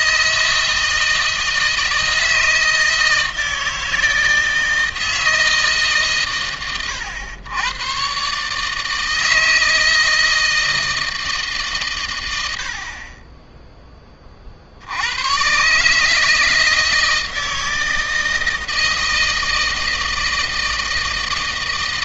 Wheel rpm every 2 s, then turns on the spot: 160, 160, 160, 100, 140, 160, 80, 40, 160, 160, 160.
none